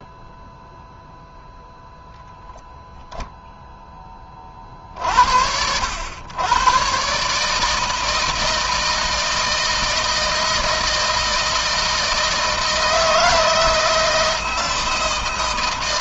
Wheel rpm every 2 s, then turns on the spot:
0, 10, 30, 100, 160, 160, 160, 170.
none